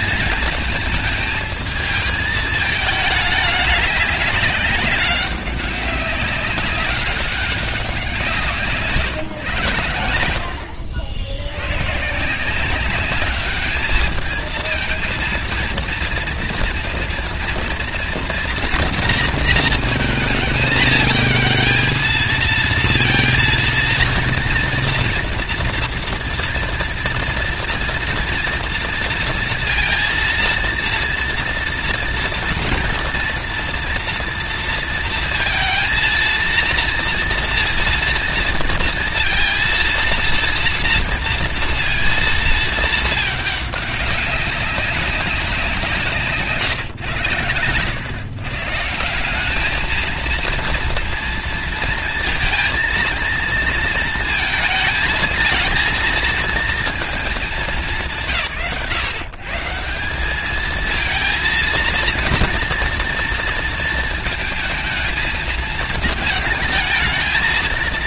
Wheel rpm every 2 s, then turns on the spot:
220, 220, 200, 200, 160, 80, 180, 220, 230, 230, 220, 230, 230, 230, 230, 230, 240, 230, 230, 230, 230, 220, 190, 140, 150, 230, 220, 220, 230, 130, 210, 230, 220, 220.
8-10